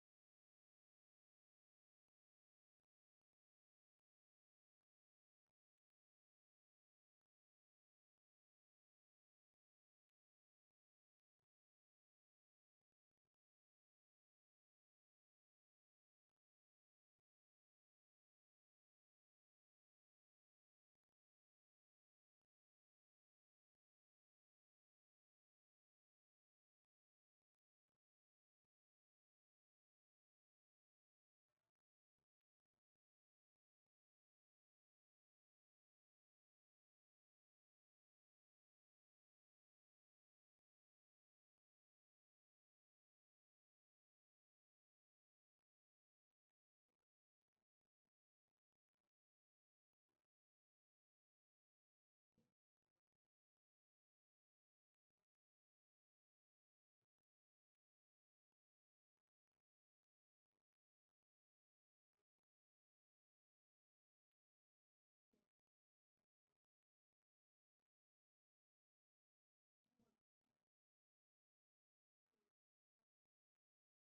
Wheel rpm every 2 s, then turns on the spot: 0, 0, 0, 0, 0, 0, 0, 0, 0, 0, 0, 0, 0, 0, 0, 0, 0, 0, 0, 0, 0, 0, 0, 0, 0, 0, 0, 0, 0, 0, 0, 0, 0, 0, 0, 0, 0.
none